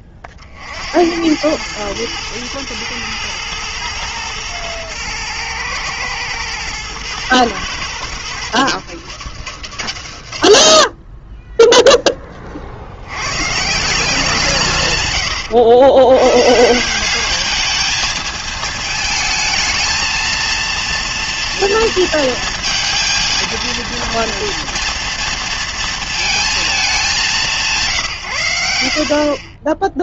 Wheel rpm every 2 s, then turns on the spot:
60, 110, 110, 110, 120, 70, 40, 150, 150, 220, 230, 230, 230, 220, 90.
none